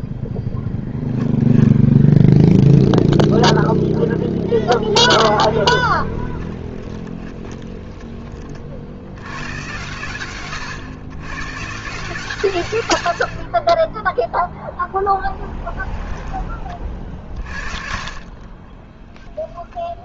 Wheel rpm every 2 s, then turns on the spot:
10, 0, 10, 20, 60, 120, 110, 10, 40, 20.
6-8 18-20